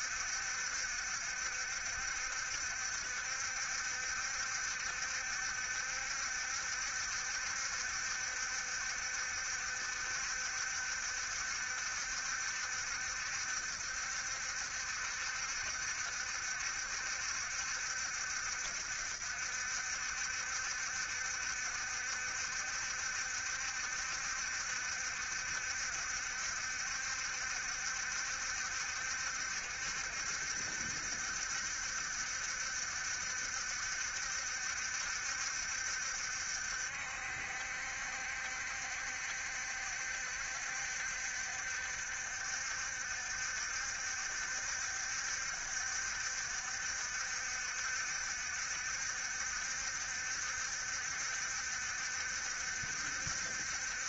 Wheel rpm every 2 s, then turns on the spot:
70, 70, 70, 70, 70, 70, 70, 70, 70, 70, 70, 70, 70, 70, 70, 70, 70, 70, 70, 70, 70, 70, 70, 70, 60, 70, 70.
none